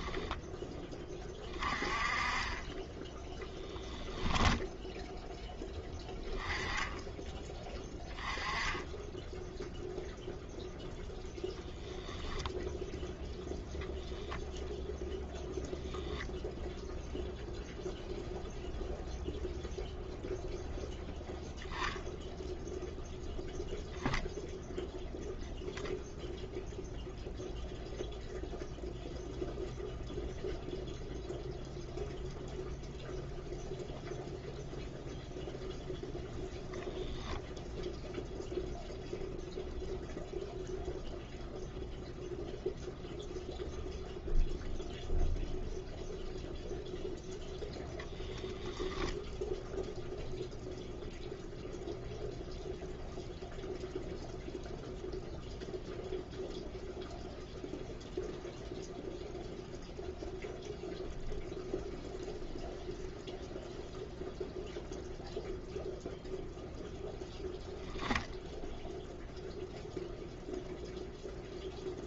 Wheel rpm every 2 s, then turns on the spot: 10, 10, 0, 10, 10, 0, 0, 0, 0, 0, 0, 0, 0, 0, 0, 0, 0, 0, 0, 0, 0, 0, 0, 0, 0, 0, 0, 0, 0, 0, 0, 0, 0, 0, 0, 0.
none